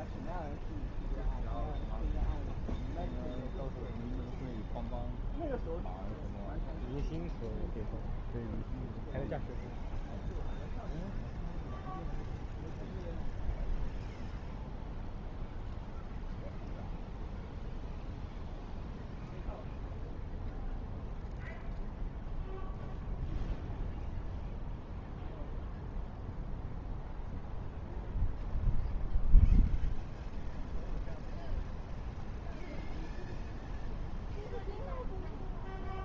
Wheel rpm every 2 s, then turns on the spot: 0, 0, 0, 0, 0, 0, 0, 0, 0, 0, 0, 0, 0, 0, 0, 0, 0, 0.
none